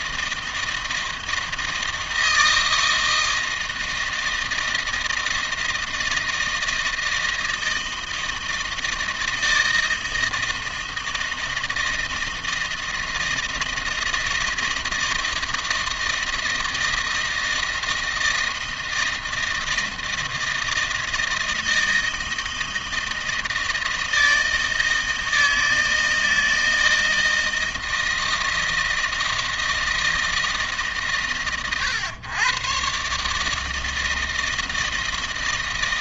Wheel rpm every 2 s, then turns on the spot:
160, 160, 160, 160, 160, 160, 160, 160, 160, 160, 160, 160, 160, 160, 160, 140, 140, 160.
none